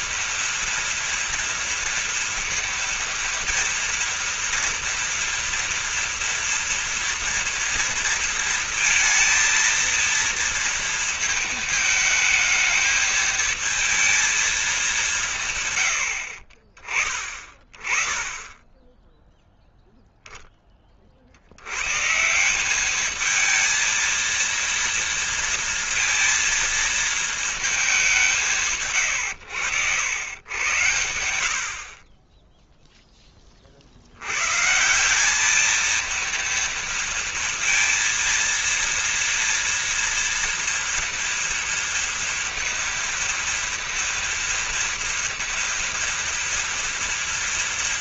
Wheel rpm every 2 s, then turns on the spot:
230, 230, 240, 230, 230, 230, 220, 190, 40, 10, 30, 210, 230, 230, 130, 100, 10, 170, 230, 230, 230, 230, 230, 230.
none